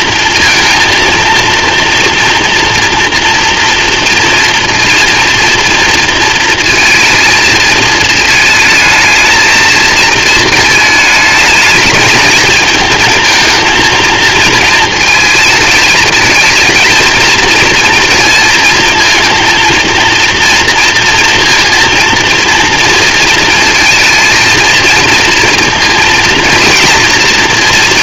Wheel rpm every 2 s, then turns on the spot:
230, 230, 230, 230, 220, 210, 220, 220, 220, 230, 230, 230, 230, 230.
none